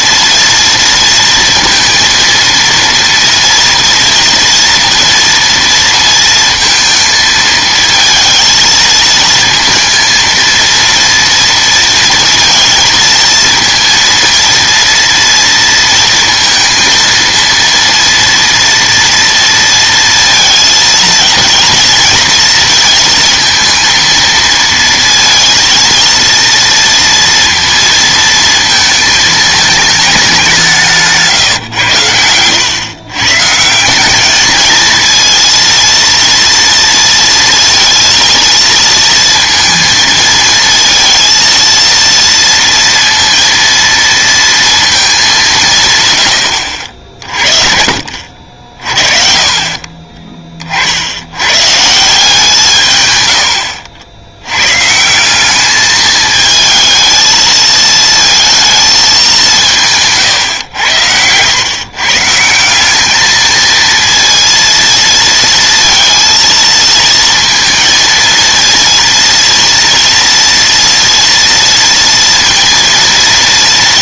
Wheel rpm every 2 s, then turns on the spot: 230, 230, 230, 230, 220, 230, 230, 230, 230, 230, 230, 230, 230, 230, 220, 180, 110, 220, 230, 230, 230, 230, 230, 80, 40, 40, 150, 130, 220, 230, 100, 170, 230, 230, 230, 230, 230.
48-50